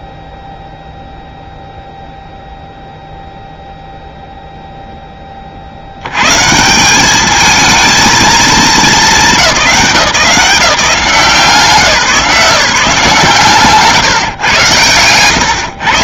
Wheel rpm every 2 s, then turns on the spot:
0, 0, 0, 150, 220, 180, 160, 120.
none